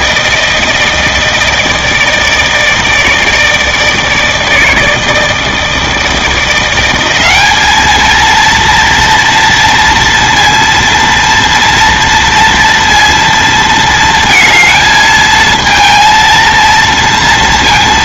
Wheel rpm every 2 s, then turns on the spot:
160, 160, 160, 180, 230, 230, 230, 220, 230.
none